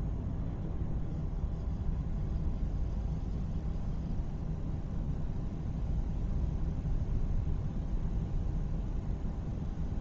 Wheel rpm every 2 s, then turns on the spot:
0, 0, 0, 0, 0.
none